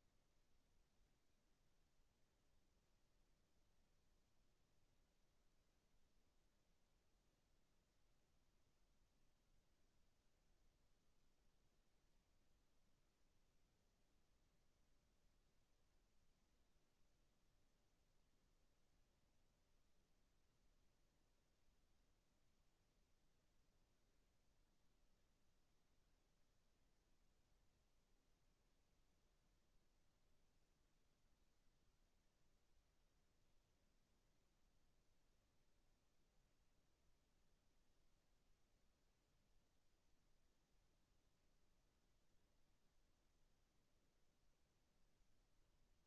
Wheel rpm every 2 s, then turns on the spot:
0, 0, 0, 0, 0, 0, 0, 0, 0, 0, 0, 0, 0, 0, 0, 0, 0, 0, 0, 0, 0, 0, 0.
none